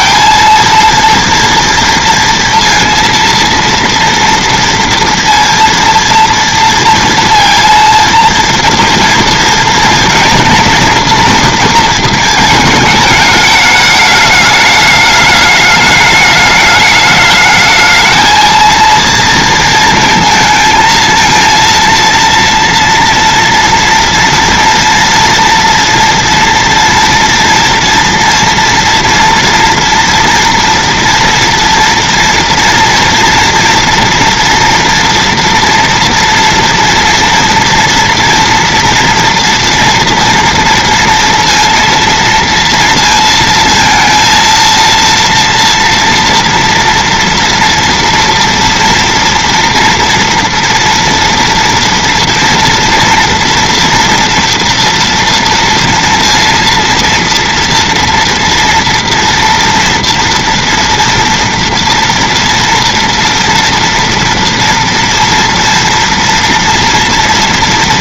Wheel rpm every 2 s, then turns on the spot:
230, 230, 230, 230, 230, 230, 220, 210, 210, 230, 220, 230, 240, 240, 230, 230, 240, 230, 230, 230, 230, 230, 230, 230, 230, 230, 230, 230, 230, 230, 230, 230, 240, 230.
none